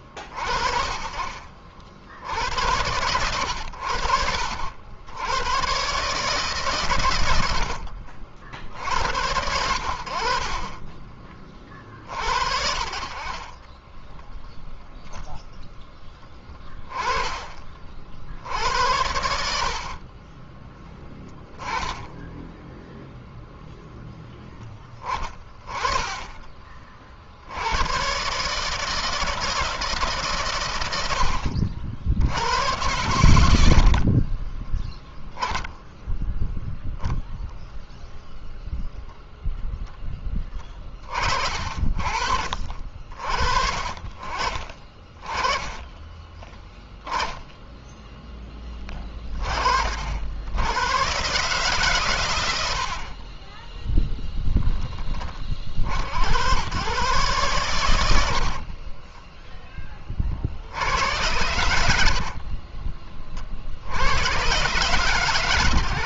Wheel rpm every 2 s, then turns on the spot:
50, 90, 90, 110, 80, 30, 40, 0, 20, 80, 10, 0, 20, 40, 150, 100, 100, 20, 0, 0, 30, 50, 30, 0, 20, 110, 90, 20, 130, 30, 80, 30, 130.
10-12 16-20 34-36 52-54 58-62